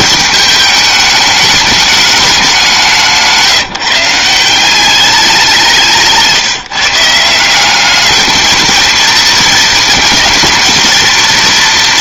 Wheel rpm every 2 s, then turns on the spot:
210, 190, 180, 160, 220, 220.
none